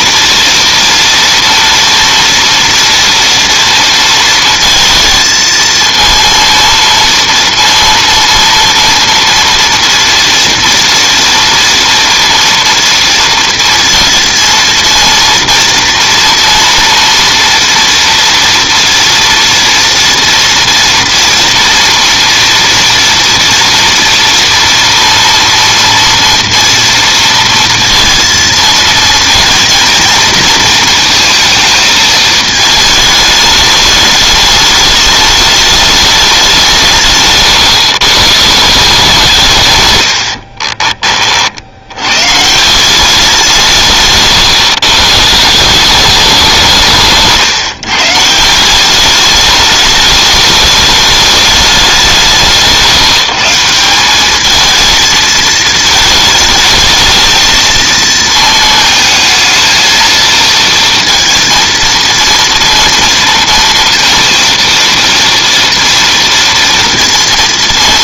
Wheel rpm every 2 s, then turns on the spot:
240, 230, 230, 230, 230, 230, 230, 230, 230, 230, 230, 230, 230, 230, 230, 230, 220, 210, 170, 160, 30, 170, 140, 170, 180, 210, 160, 220, 220, 220, 230, 230, 230, 230.
40-42